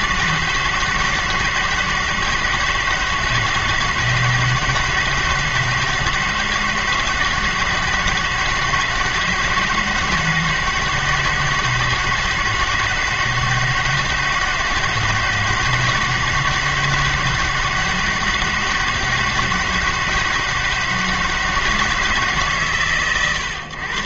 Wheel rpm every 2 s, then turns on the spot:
160, 160, 160, 160, 160, 160, 160, 160, 160, 160, 150, 140.
none